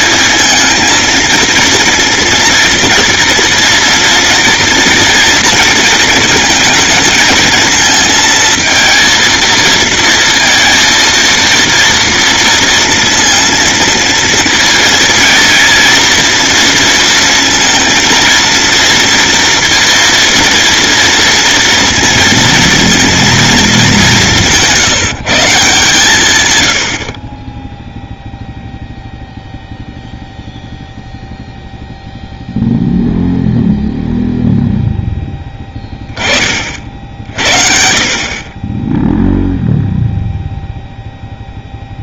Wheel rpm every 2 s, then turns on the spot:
230, 240, 230, 220, 230, 230, 230, 230, 230, 230, 230, 230, 170, 20, 0, 0, 0, 10, 60, 0, 0.
none